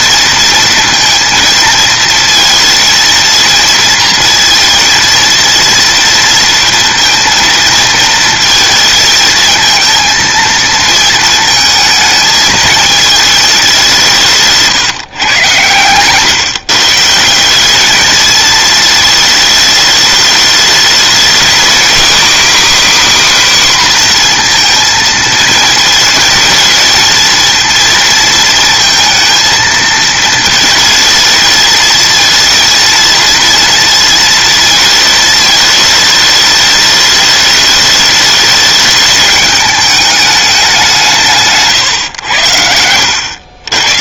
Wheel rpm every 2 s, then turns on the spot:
230, 230, 230, 230, 220, 230, 220, 190, 130, 210, 210, 250, 250, 220, 230, 220, 230, 230, 210, 210, 210, 120.
16-18